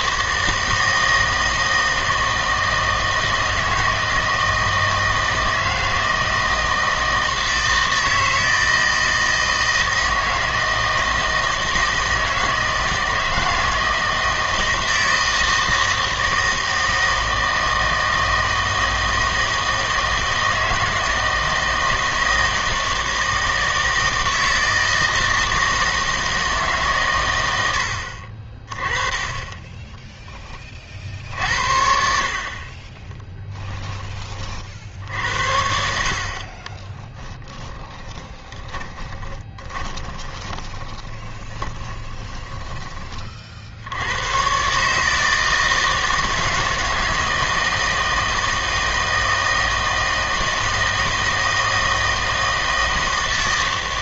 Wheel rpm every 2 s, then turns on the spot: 160, 160, 160, 160, 160, 160, 160, 160, 160, 160, 160, 160, 160, 150, 30, 20, 40, 60, 30, 20, 20, 20, 130, 160, 160, 160, 160.
36-44